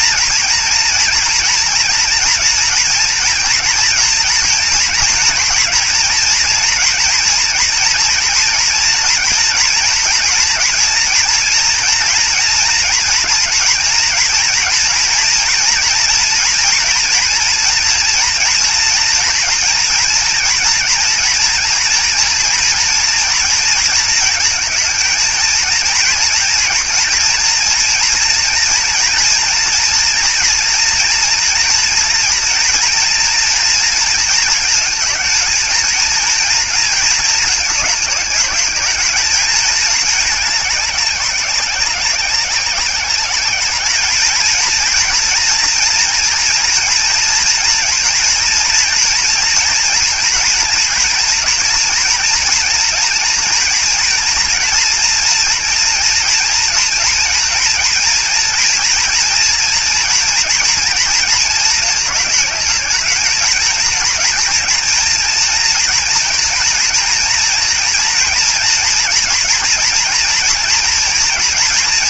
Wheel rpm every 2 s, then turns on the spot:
230, 230, 230, 240, 240, 230, 230, 230, 230, 230, 230, 230, 230, 230, 230, 230, 230, 230, 230, 220, 210, 190, 230, 230, 230, 230, 230, 230, 230, 230, 230, 210, 230, 230, 230, 240.
none